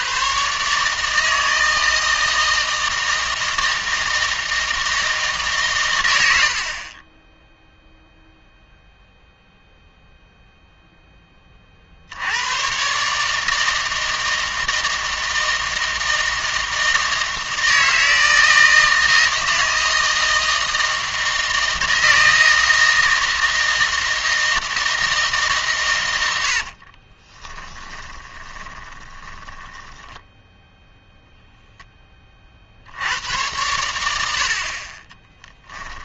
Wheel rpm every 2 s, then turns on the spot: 140, 160, 160, 60, 0, 0, 120, 160, 160, 160, 160, 160, 160, 60, 20, 0, 70, 30.
26-30